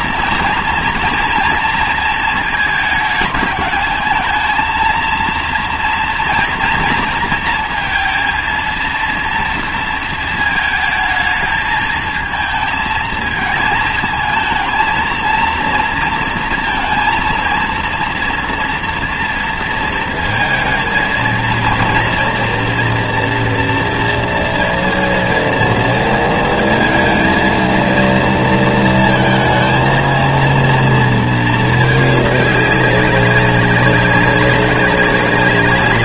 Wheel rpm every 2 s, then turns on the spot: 230, 220, 220, 230, 230, 220, 220, 230, 230, 230, 220, 230, 230, 230, 230, 230, 200, 190.
none